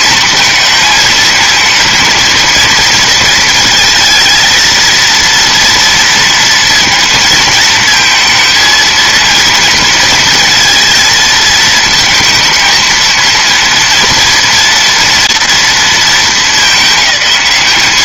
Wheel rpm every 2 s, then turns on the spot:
220, 230, 230, 230, 230, 230, 230, 240, 200.
none